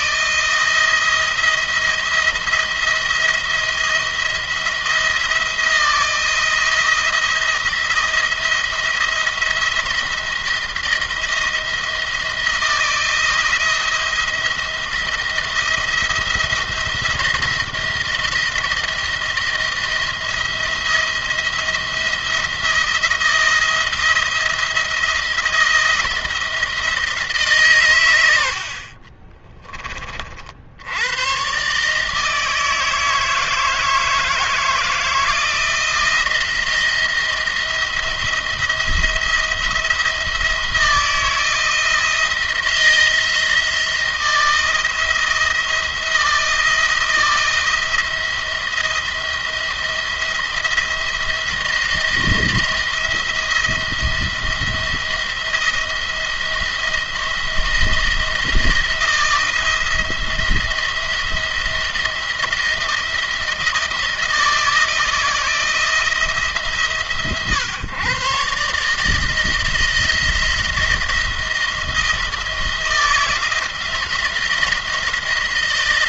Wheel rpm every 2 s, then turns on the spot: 160, 170, 170, 170, 170, 170, 170, 170, 170, 170, 170, 170, 170, 160, 70, 60, 160, 160, 170, 170, 170, 170, 170, 170, 170, 170, 170, 170, 170, 170, 170, 170, 170, 150, 140, 170, 170, 170.
none